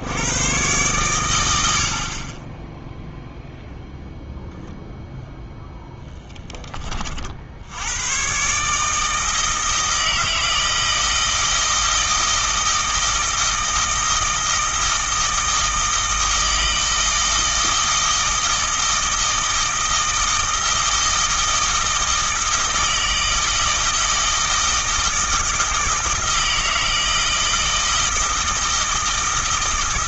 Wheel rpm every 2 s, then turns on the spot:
120, 10, 0, 20, 150, 160, 160, 160, 160, 160, 160, 160, 160, 160, 160.
none